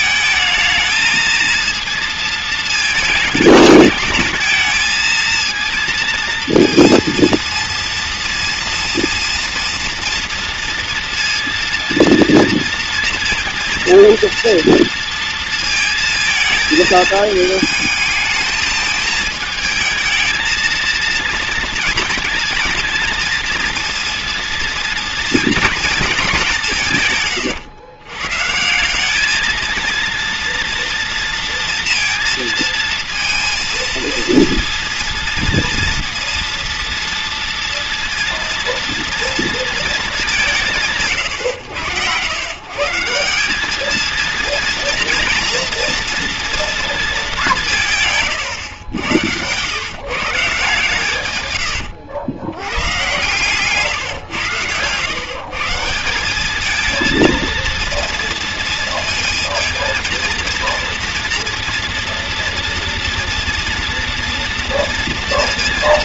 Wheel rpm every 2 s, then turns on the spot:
220, 220, 220, 230, 230, 230, 230, 230, 220, 220, 230, 230, 230, 160, 180, 240, 230, 230, 230, 230, 150, 150, 230, 230, 100, 140, 100, 110, 220, 230, 230, 230, 230.
none